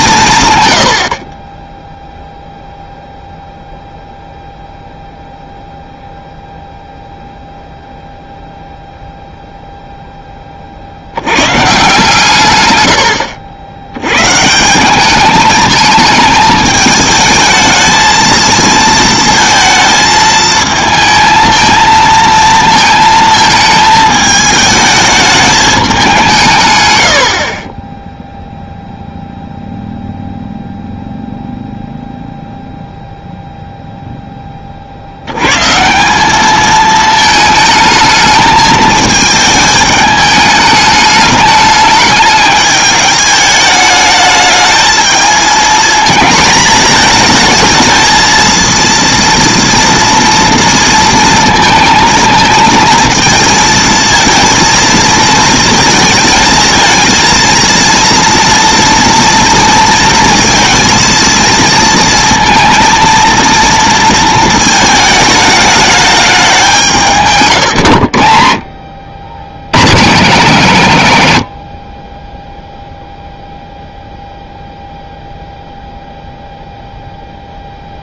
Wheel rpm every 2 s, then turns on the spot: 110, 0, 0, 0, 0, 40, 120, 170, 210, 230, 220, 220, 210, 140, 0, 0, 0, 30, 210, 220, 210, 210, 220, 220, 230, 230, 220, 230, 220, 230, 230, 230, 220, 190, 60, 140, 0, 0, 0.
none